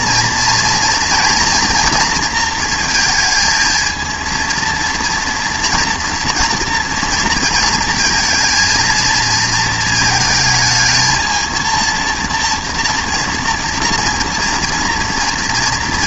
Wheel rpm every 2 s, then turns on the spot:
240, 230, 230, 240, 230, 220, 230, 230.
none